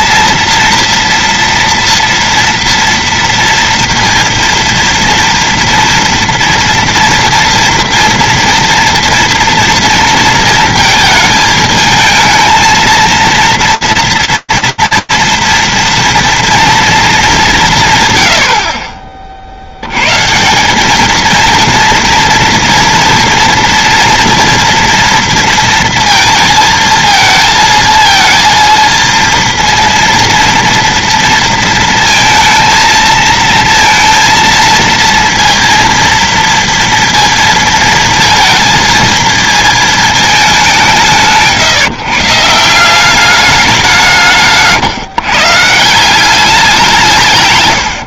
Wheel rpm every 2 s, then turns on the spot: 230, 230, 230, 230, 230, 230, 220, 230, 230, 60, 210, 240, 230, 220, 230, 230, 220, 230, 230, 230, 180, 190, 150, 180.
none